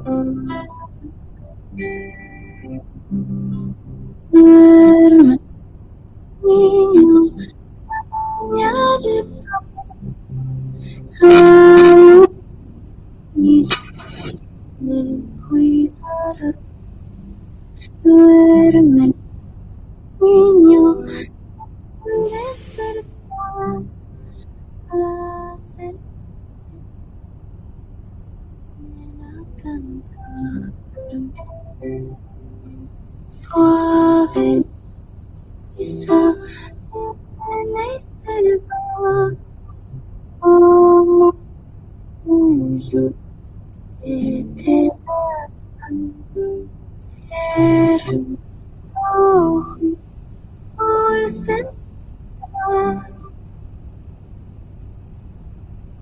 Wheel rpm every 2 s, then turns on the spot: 0, 0, 0, 0, 0, 0, 0, 0, 0, 0, 0, 0, 0, 0, 0, 0, 0, 0, 0, 0, 0, 0, 0, 0, 0, 0, 0, 0.
none